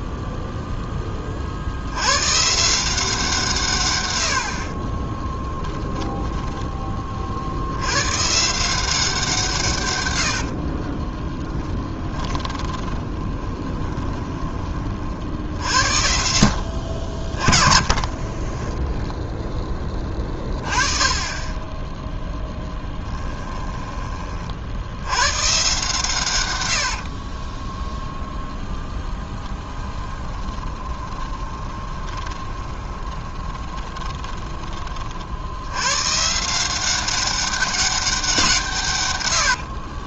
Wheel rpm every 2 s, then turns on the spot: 10, 160, 30, 10, 170, 40, 20, 30, 50, 20, 20, 10, 70, 70, 0, 20, 20, 30, 180, 150.
10-14 18-20 22-24 26-28 30-34